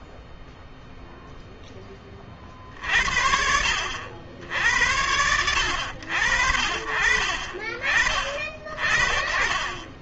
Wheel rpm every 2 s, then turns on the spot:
0, 40, 70, 60, 40.
none